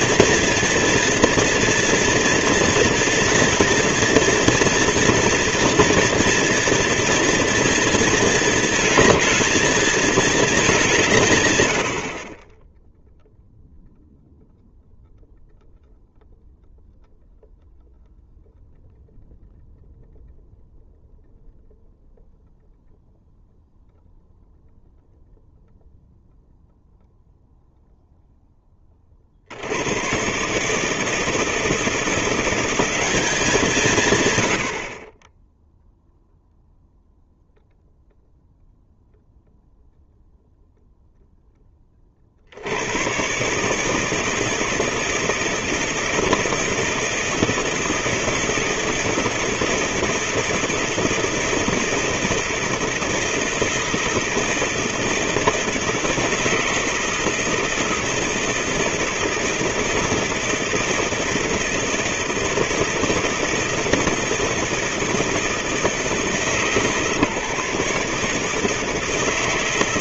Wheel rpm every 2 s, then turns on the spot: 230, 230, 230, 230, 220, 160, 0, 0, 0, 0, 0, 0, 0, 0, 90, 160, 170, 0, 0, 0, 10, 130, 160, 160, 160, 160, 160, 170, 160, 160, 160, 160, 160, 150, 160.
none